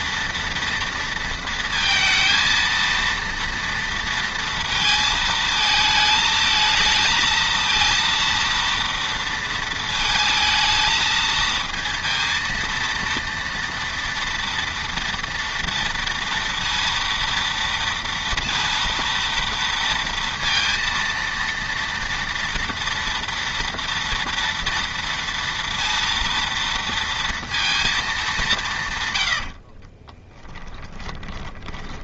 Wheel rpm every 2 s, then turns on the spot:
240, 230, 230, 220, 230, 220, 230, 230, 230, 230, 230, 230, 230, 230, 160, 10.
30-32